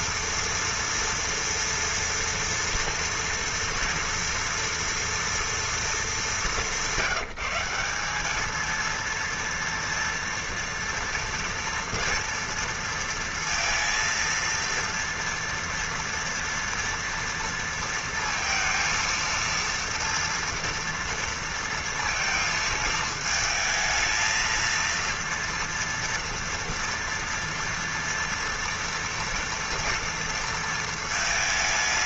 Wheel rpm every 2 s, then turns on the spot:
240, 230, 230, 200, 210, 240, 230, 230, 230, 230, 230, 220, 230, 230, 230, 230.
none